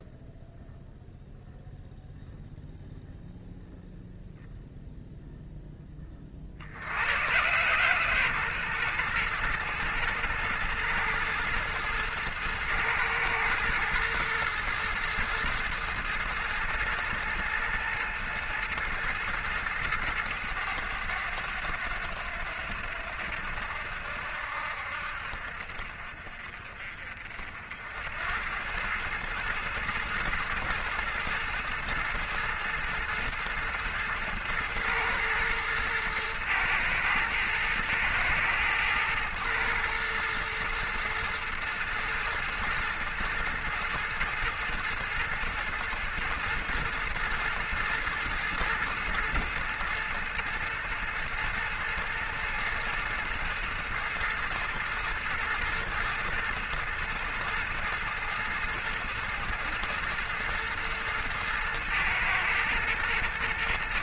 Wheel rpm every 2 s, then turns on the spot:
0, 0, 0, 80, 120, 110, 110, 110, 110, 110, 100, 80, 70, 50, 100, 110, 110, 110, 110, 110, 120, 110, 110, 110, 110, 120, 110, 120, 110, 110, 110, 110.
none